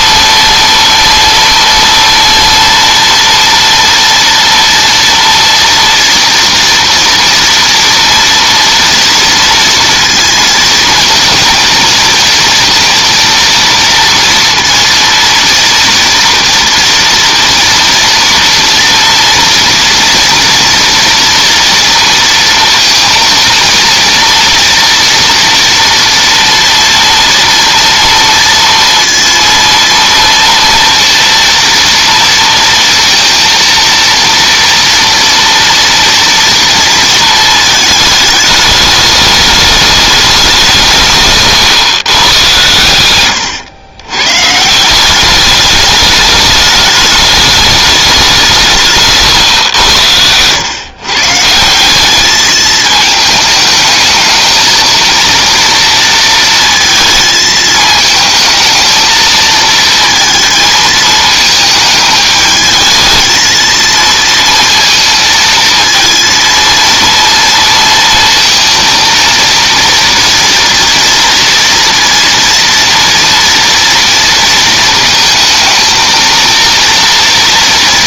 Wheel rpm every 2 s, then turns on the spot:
230, 230, 230, 230, 230, 230, 230, 230, 230, 230, 230, 230, 230, 230, 230, 230, 230, 230, 230, 210, 170, 100, 170, 210, 160, 120, 220, 230, 230, 220, 220, 220, 230, 230, 230, 230, 230, 230, 230.
none